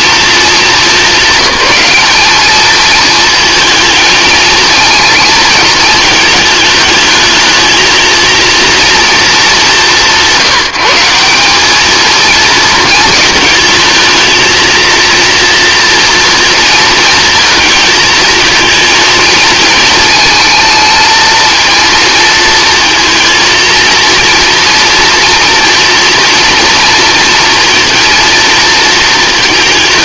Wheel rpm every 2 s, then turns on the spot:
190, 220, 220, 210, 230, 180, 220, 230, 230, 220, 230, 220, 230, 230, 220.
none